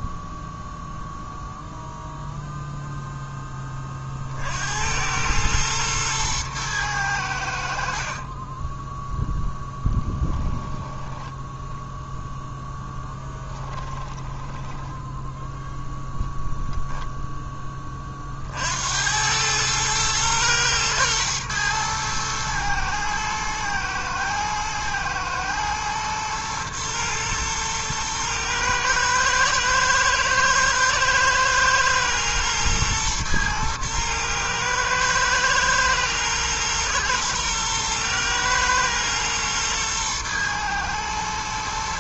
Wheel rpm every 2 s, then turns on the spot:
0, 0, 90, 100, 10, 10, 10, 10, 0, 80, 110, 110, 120, 110, 110, 110, 110, 110, 120, 110, 120.
8-16